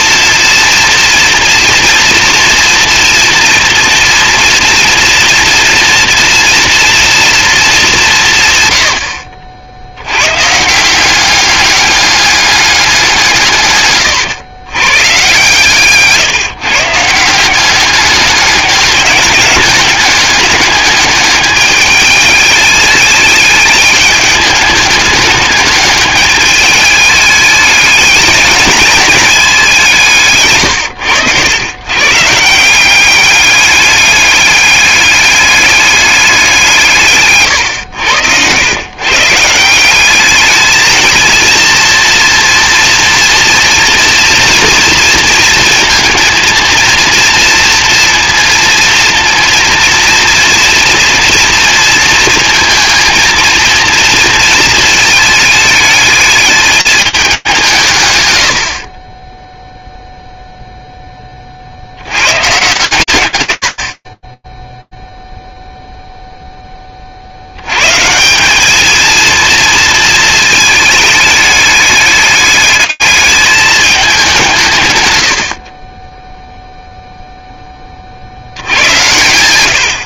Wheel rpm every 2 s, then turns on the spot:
230, 240, 240, 230, 120, 170, 190, 120, 150, 200, 210, 210, 210, 210, 220, 100, 180, 200, 160, 120, 220, 230, 230, 230, 230, 230, 230, 220, 210, 30, 0, 150, 10, 0, 190, 220, 210, 170, 0, 100.
none